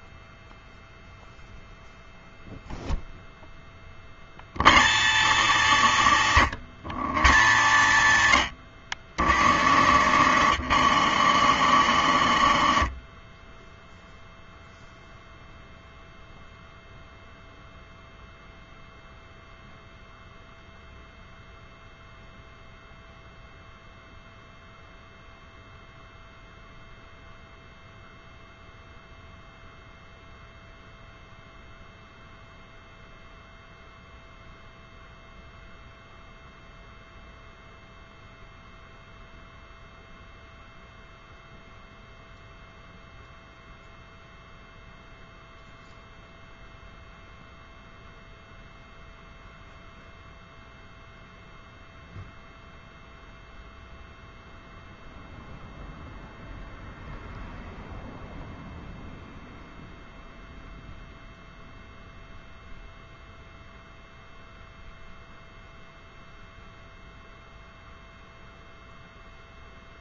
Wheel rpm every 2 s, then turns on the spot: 0, 0, 130, 130, 90, 110, 50, 0, 0, 0, 0, 0, 0, 0, 0, 0, 0, 0, 0, 0, 0, 0, 0, 0, 0, 0, 0, 0, 0, 0, 0, 0, 0, 0, 0.
10-14